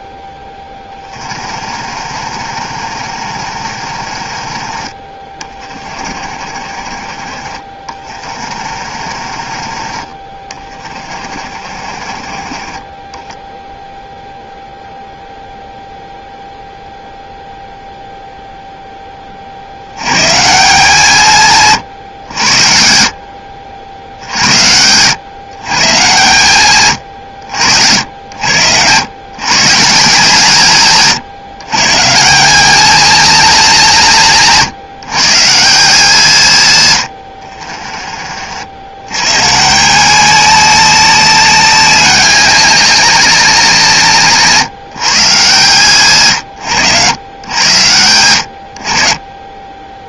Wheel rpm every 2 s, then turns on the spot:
10, 50, 40, 40, 40, 30, 20, 0, 0, 10, 160, 60, 110, 110, 120, 140, 220, 150, 100, 80, 190, 200, 150, 110, 60.
0-12